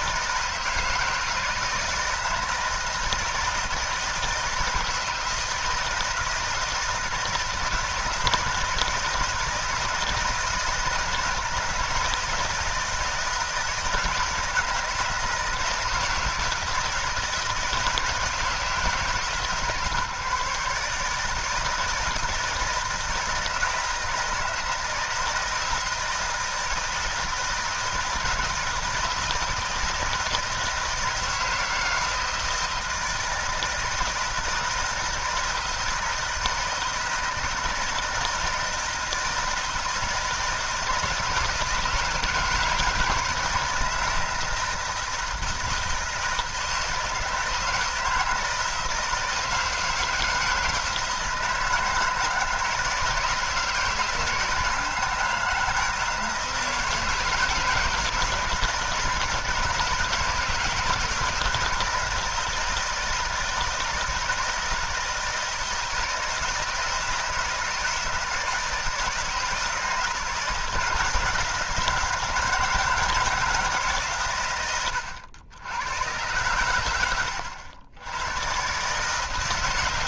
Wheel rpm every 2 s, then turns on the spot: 160, 160, 160, 160, 170, 160, 160, 170, 160, 160, 150, 160, 160, 160, 160, 160, 160, 160, 160, 160, 160, 160, 160, 160, 160, 160, 170, 160, 160, 160, 160, 160, 160, 160, 160, 160, 170, 110, 110, 130.
none